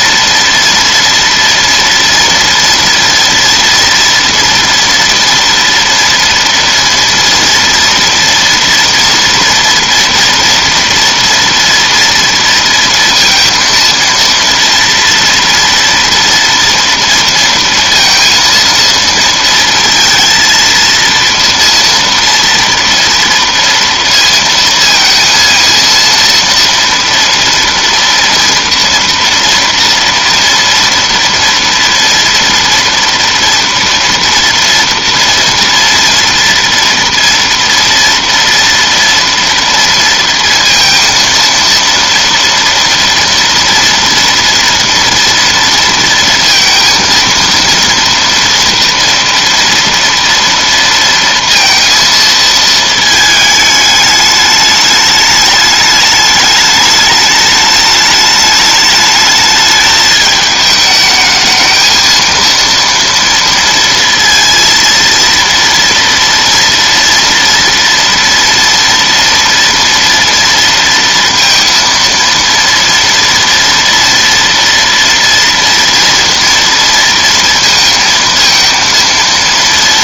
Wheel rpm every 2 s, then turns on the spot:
230, 230, 230, 230, 230, 230, 230, 230, 230, 230, 230, 240, 230, 230, 230, 230, 240, 230, 230, 230, 230, 230, 230, 230, 240, 230, 220, 210, 210, 210, 220, 230, 230, 230, 230, 230, 230, 230, 230, 230.
none